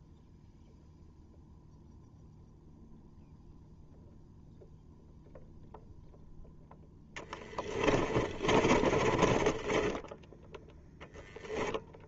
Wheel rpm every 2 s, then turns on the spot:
0, 0, 0, 10, 30, 20.
8-12